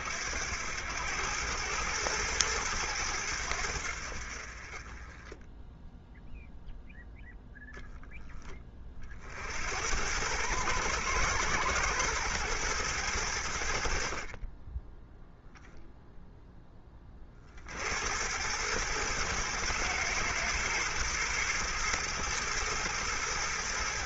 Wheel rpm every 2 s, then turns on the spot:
90, 100, 30, 0, 30, 110, 100, 10, 20, 110, 110, 110.
none